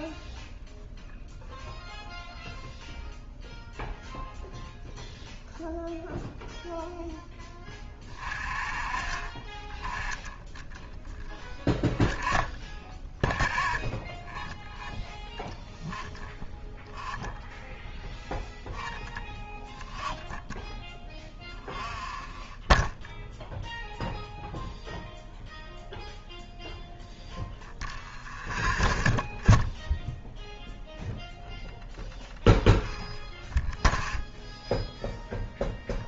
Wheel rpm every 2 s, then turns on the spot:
0, 0, 0, 0, 40, 10, 0, 0, 0, 0, 0, 0, 0, 0, 0, 0, 0, 0.
none